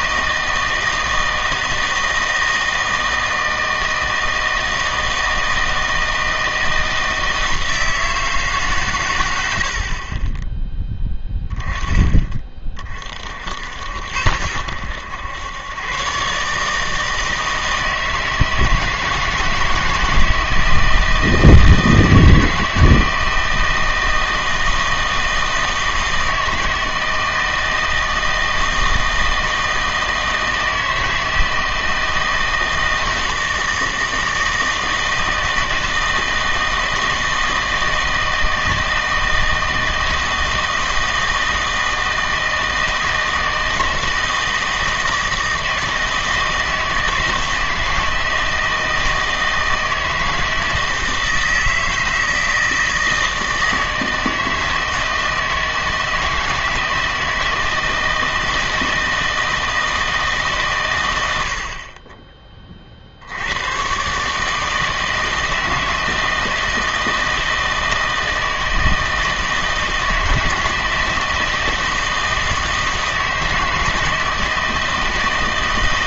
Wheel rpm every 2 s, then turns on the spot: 160, 160, 160, 160, 120, 10, 40, 90, 160, 160, 160, 160, 160, 160, 160, 160, 160, 160, 160, 160, 160, 160, 160, 160, 160, 160, 160, 160, 160, 160, 130, 40, 160, 160, 160, 160, 160, 160.
none